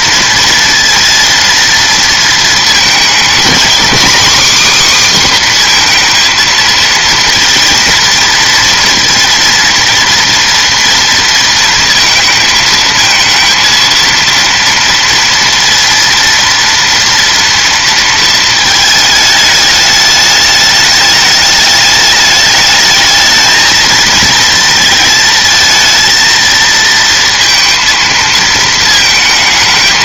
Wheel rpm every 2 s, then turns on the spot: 230, 230, 270, 230, 230, 240, 220, 230, 230, 220, 210, 210, 220, 230, 220.
none